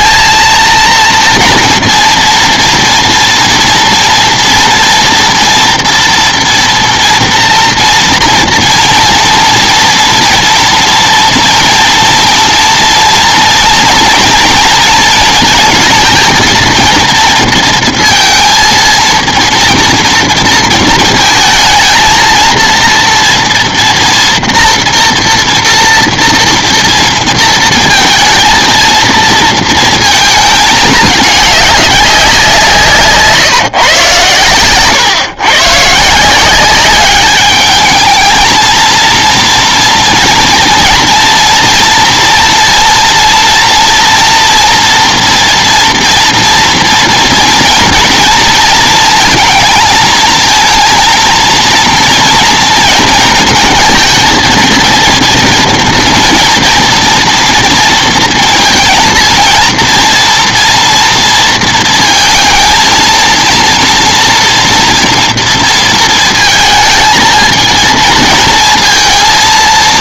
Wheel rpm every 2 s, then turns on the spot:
220, 230, 230, 240, 230, 230, 230, 230, 230, 230, 230, 230, 230, 230, 230, 220, 180, 110, 180, 220, 230, 230, 230, 230, 230, 230, 230, 230, 230, 230, 230, 230, 230, 220, 220.
none